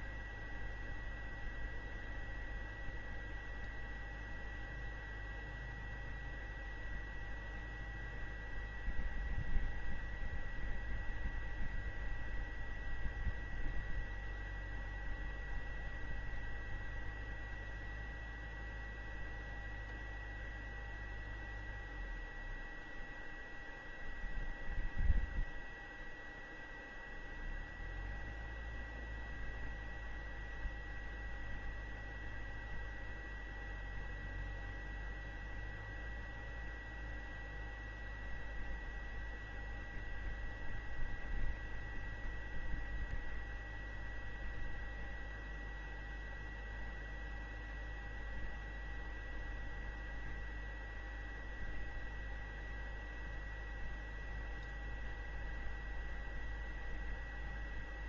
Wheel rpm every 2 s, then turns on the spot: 0, 0, 0, 0, 0, 0, 0, 0, 0, 0, 0, 0, 0, 0, 0, 0, 0, 0, 0, 0, 0, 0, 0, 0, 0, 0, 0, 0, 0.
none